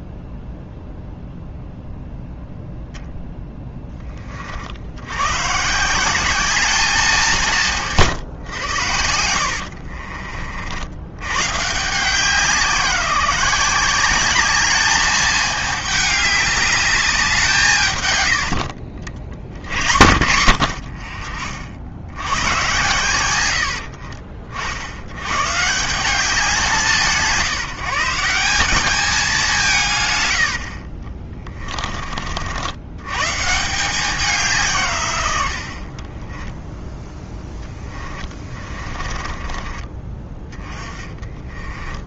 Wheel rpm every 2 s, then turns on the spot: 0, 0, 60, 200, 90, 90, 170, 210, 200, 70, 70, 110, 60, 180, 200, 50, 90, 140, 20, 30, 20.
38-42